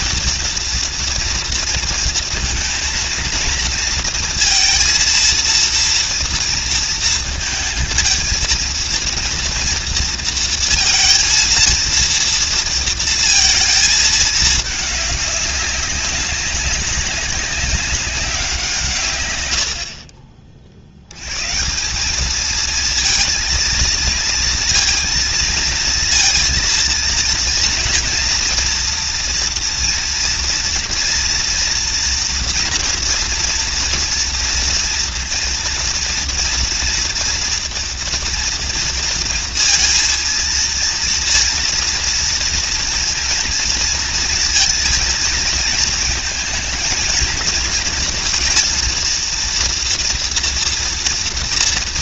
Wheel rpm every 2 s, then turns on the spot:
230, 230, 230, 230, 230, 230, 230, 210, 200, 170, 60, 220, 230, 230, 240, 230, 230, 230, 230, 230, 230, 230, 230, 220, 230, 230.
none